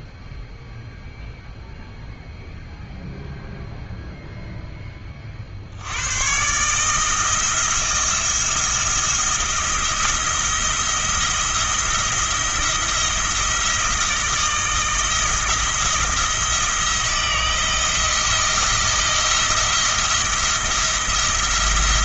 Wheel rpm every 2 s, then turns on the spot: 0, 0, 20, 160, 170, 170, 170, 160, 170, 170, 170.
none